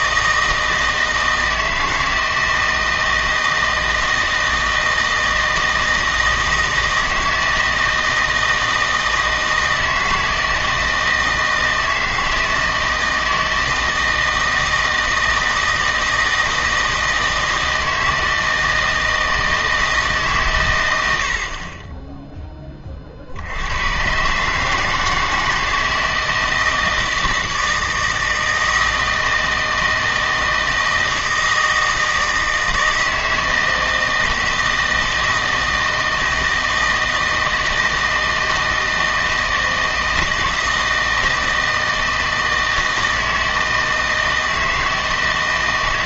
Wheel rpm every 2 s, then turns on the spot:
160, 160, 160, 160, 160, 160, 160, 160, 160, 160, 110, 20, 150, 160, 160, 160, 160, 160, 160, 160, 160, 160, 160.
none